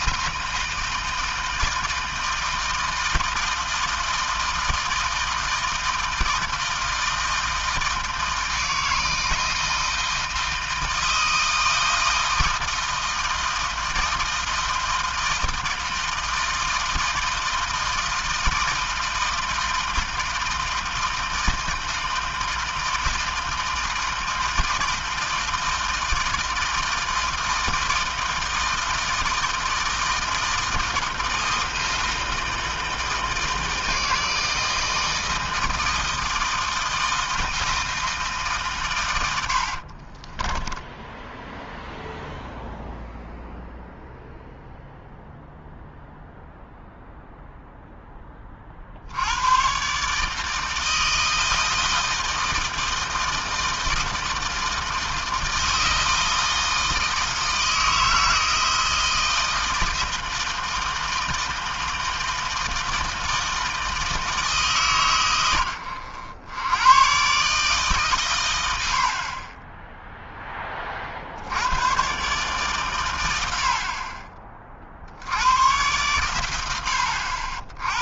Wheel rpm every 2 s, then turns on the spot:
160, 160, 160, 160, 160, 160, 160, 160, 160, 160, 160, 160, 160, 160, 160, 170, 160, 160, 160, 110, 10, 0, 0, 0, 80, 160, 160, 160, 160, 160, 160, 160, 130, 130, 50, 50, 100, 60, 90.
40-42